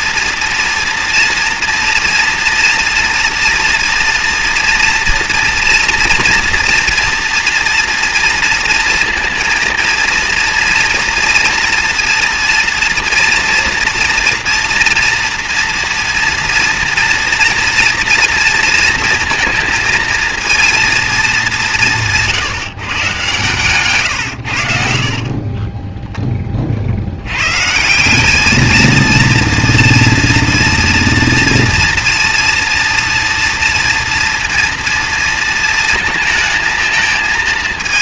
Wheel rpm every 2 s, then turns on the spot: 230, 230, 230, 230, 230, 240, 230, 230, 240, 230, 230, 140, 50, 70, 220, 230, 230, 230, 220.
24-26